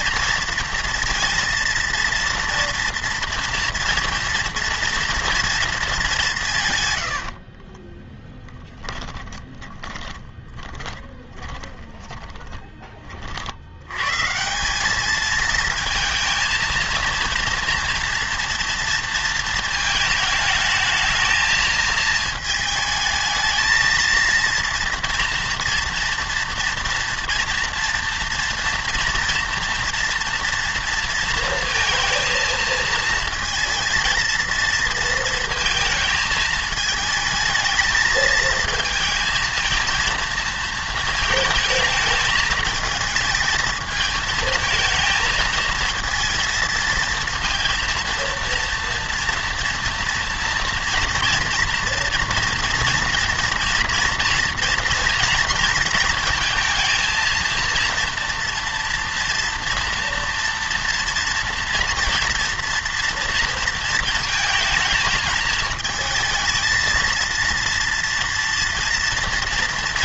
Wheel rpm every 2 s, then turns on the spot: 230, 230, 230, 160, 20, 20, 20, 180, 230, 230, 220, 220, 230, 230, 230, 230, 220, 230, 220, 220, 230, 220, 220, 230, 230, 230, 230, 230, 220, 230, 230, 230, 220, 230, 240.
8-12